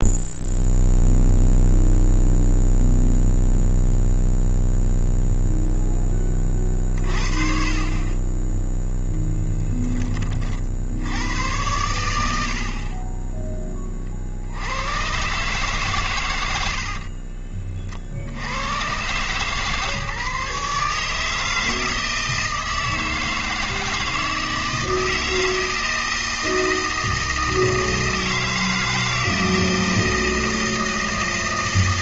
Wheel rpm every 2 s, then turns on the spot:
0, 0, 0, 40, 10, 50, 60, 90, 70, 110, 150, 160, 160, 160, 160, 160.
16-18